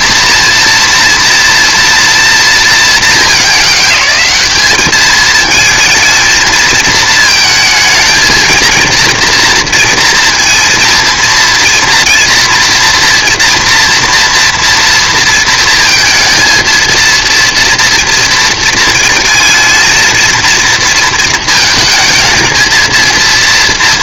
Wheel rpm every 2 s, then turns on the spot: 230, 230, 200, 230, 230, 230, 230, 230, 230, 220, 230, 220.
none